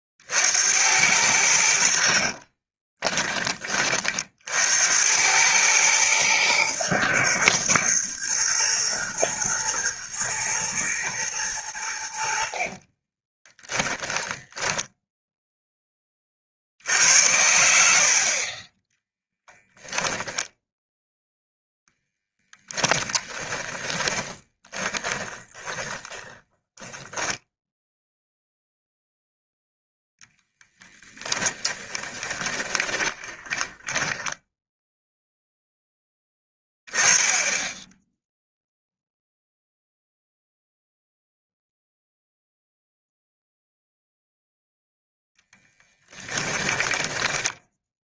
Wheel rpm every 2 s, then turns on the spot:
80, 30, 80, 110, 110, 110, 40, 10, 80, 20, 10, 20, 20, 10, 0, 10, 20, 0, 10, 0, 0, 0, 0, 10.
2-4 12-16 22-28 32-34 46-48